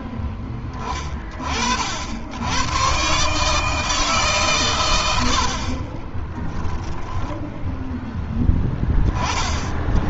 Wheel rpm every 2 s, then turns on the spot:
10, 110, 120, 10, 20.
6-8